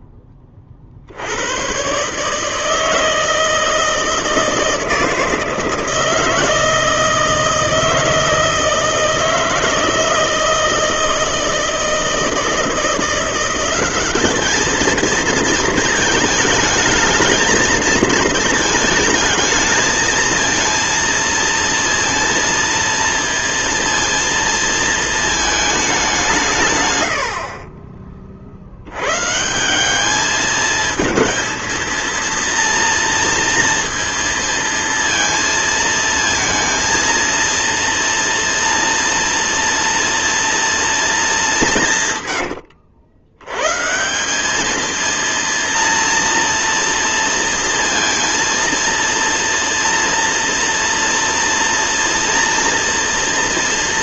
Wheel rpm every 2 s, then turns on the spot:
40, 160, 160, 160, 160, 160, 170, 220, 220, 220, 230, 230, 230, 130, 90, 220, 230, 230, 230, 230, 230, 80, 220, 230, 230, 240, 230.
42-44